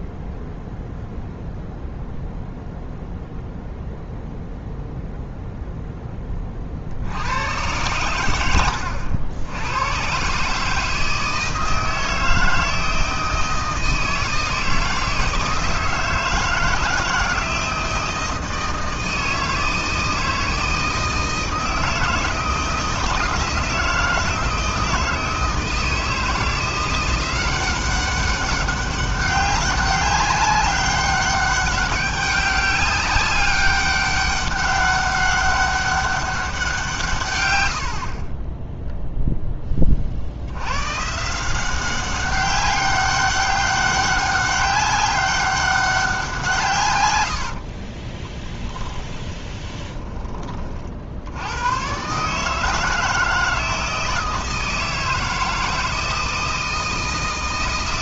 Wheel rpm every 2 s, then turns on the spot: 0, 0, 0, 50, 90, 160, 160, 160, 160, 160, 160, 160, 160, 170, 190, 190, 190, 200, 160, 0, 110, 200, 200, 130, 20, 40, 160, 160, 160.
48-50